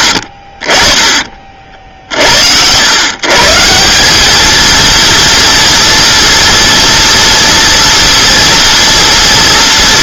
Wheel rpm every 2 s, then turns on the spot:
40, 90, 220, 230, 230.
none